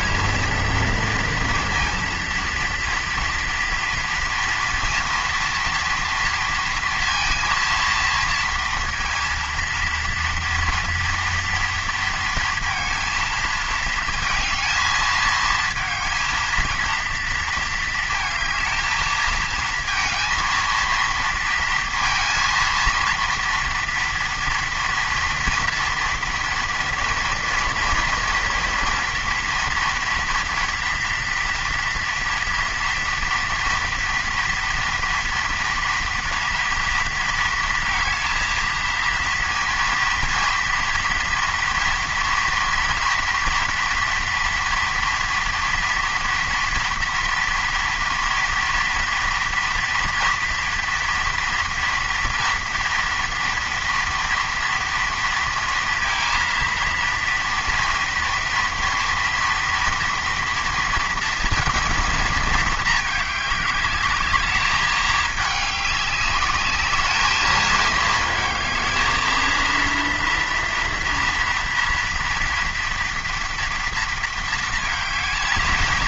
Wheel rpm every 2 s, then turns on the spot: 230, 230, 230, 230, 230, 230, 230, 220, 230, 220, 230, 230, 230, 230, 230, 230, 230, 230, 230, 230, 230, 230, 230, 230, 240, 230, 230, 230, 230, 230, 230, 220, 210, 200, 220, 230, 240, 220.
none